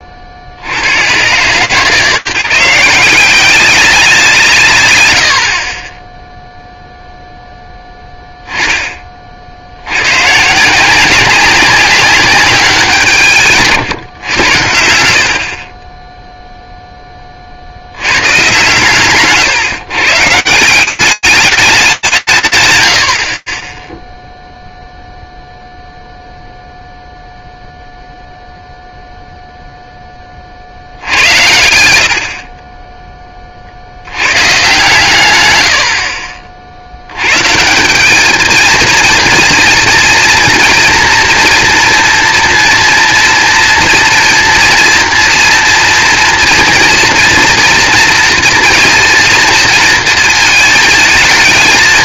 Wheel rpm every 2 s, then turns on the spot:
90, 160, 120, 0, 10, 150, 190, 100, 0, 130, 170, 120, 0, 0, 0, 90, 20, 140, 90, 230, 240, 230, 230, 240, 230, 220.
none